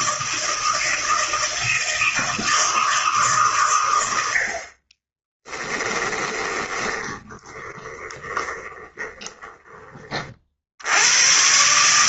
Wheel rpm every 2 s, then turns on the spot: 160, 160, 60, 20, 20, 60.
6-10